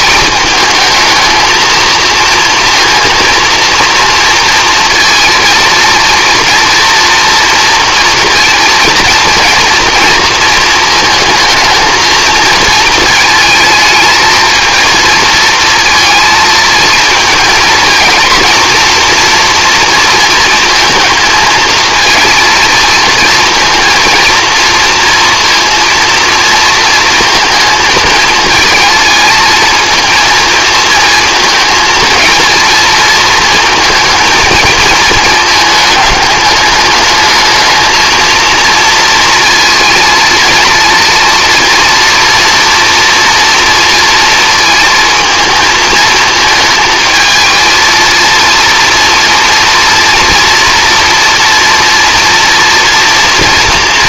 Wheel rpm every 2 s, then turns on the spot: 210, 230, 230, 240, 230, 230, 230, 220, 220, 230, 230, 230, 230, 230, 220, 220, 230, 220, 200, 230, 230, 230, 230, 220, 230, 230, 230.
none